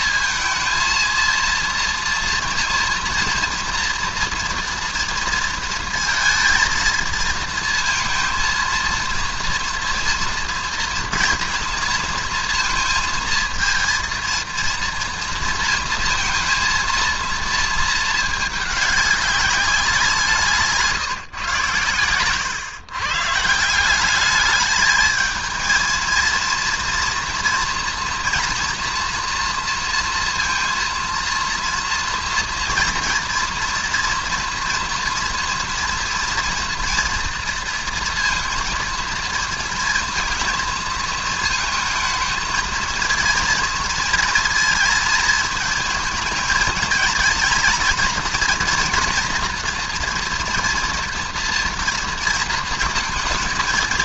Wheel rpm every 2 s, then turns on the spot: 230, 230, 230, 230, 230, 230, 230, 230, 230, 210, 160, 130, 210, 230, 230, 230, 230, 230, 230, 230, 230, 230, 230, 220, 230, 230, 230.
none